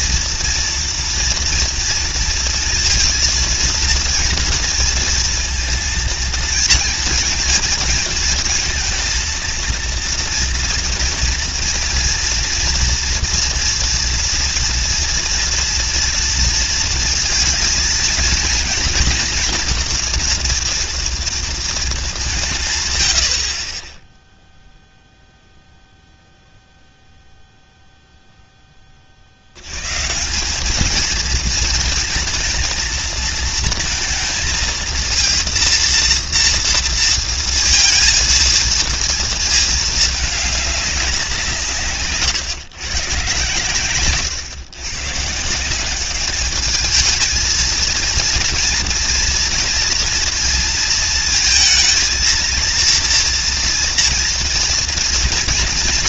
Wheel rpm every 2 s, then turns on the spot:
240, 230, 230, 230, 230, 230, 230, 240, 230, 230, 230, 130, 0, 0, 10, 200, 230, 220, 230, 230, 210, 140, 120, 200, 230, 230, 230, 240.
none